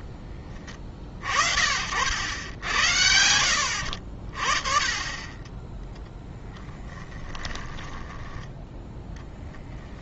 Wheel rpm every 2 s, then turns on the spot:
30, 80, 30, 10, 10.
6-8